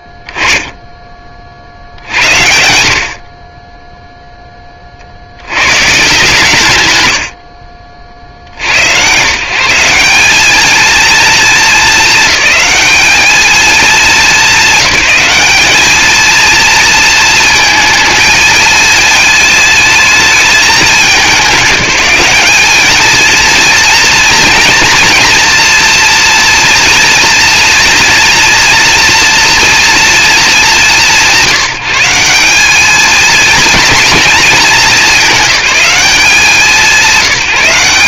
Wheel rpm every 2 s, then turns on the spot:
10, 80, 30, 140, 110, 220, 210, 200, 220, 220, 200, 220, 230, 230, 230, 160, 210, 210, 180.
none